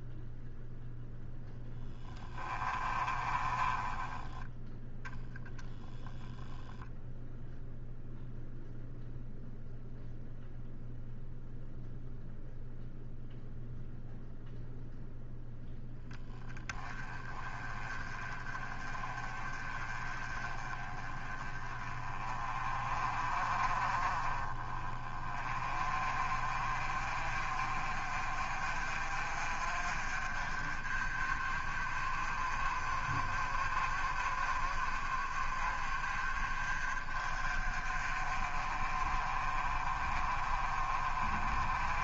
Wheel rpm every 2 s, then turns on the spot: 0, 20, 0, 0, 0, 0, 0, 0, 20, 30, 20, 30, 20, 40, 40, 40, 40, 40, 40, 40, 40.
2-4